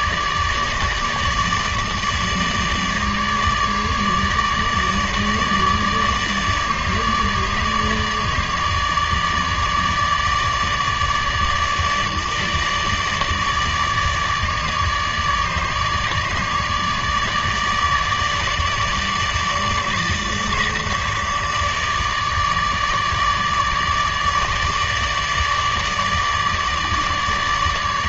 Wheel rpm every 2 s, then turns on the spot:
150, 150, 150, 150, 150, 150, 150, 150, 150, 150, 150, 150, 150, 150.
none